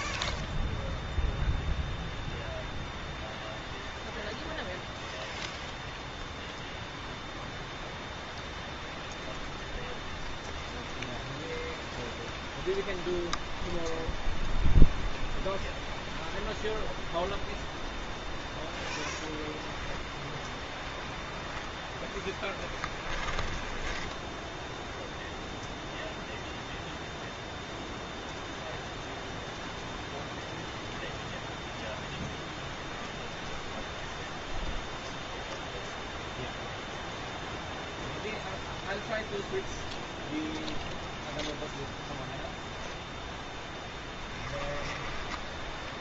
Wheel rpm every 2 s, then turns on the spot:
0, 0, 0, 0, 0, 0, 0, 0, 0, 0, 10, 10, 0, 0, 0, 0, 0, 0, 0, 0, 0, 0, 10.
22-24 44-46